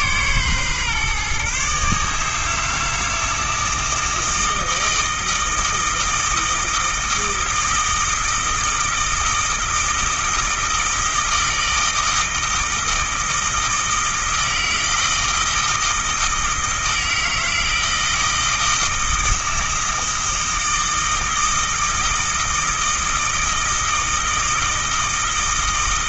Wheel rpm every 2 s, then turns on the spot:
130, 160, 160, 160, 160, 160, 160, 160, 160, 160, 160, 160, 160.
none